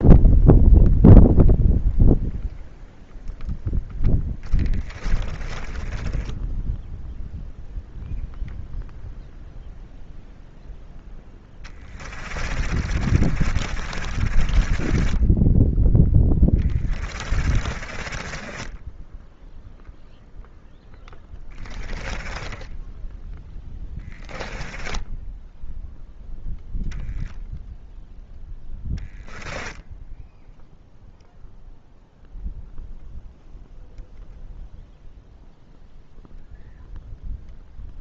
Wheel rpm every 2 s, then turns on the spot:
0, 0, 20, 0, 0, 0, 40, 20, 30, 10, 0, 10, 10, 0, 10, 0, 0, 0, 0.
4-6 12-20 22-26 28-30